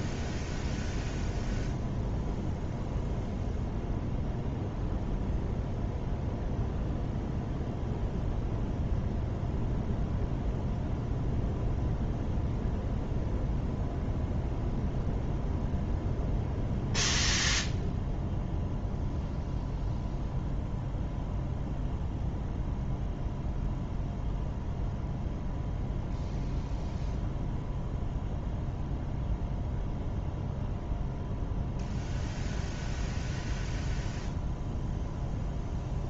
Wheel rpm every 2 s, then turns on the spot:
0, 0, 0, 0, 0, 0, 0, 0, 0, 0, 0, 0, 0, 0, 0, 0, 0, 0.
none